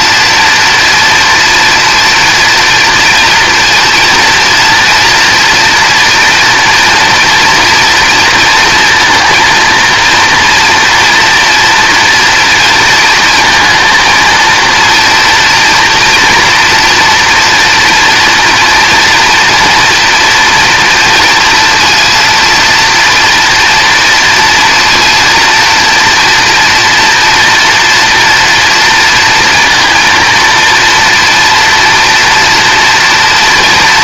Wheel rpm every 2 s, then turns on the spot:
240, 230, 230, 230, 230, 230, 230, 230, 230, 240, 230, 230, 230, 230, 230, 230, 230.
none